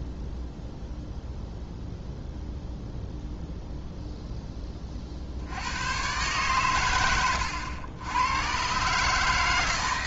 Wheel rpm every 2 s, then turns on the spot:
0, 0, 10, 120, 130.
none